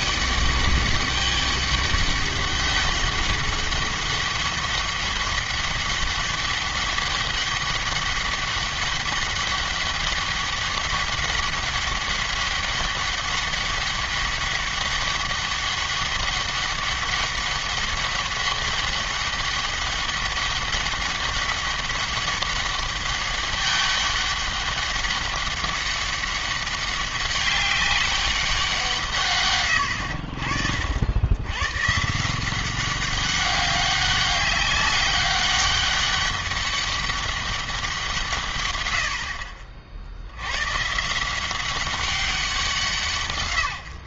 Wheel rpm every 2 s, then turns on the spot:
200, 200, 200, 200, 200, 200, 200, 200, 200, 200, 200, 200, 200, 200, 170, 60, 190, 200, 200, 110, 130, 180.
none